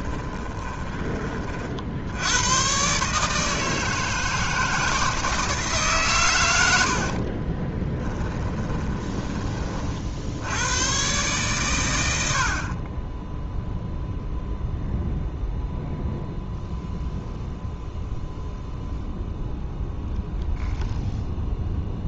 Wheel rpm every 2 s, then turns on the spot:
20, 130, 160, 80, 20, 110, 30, 0, 0, 0, 0.
0-2 8-10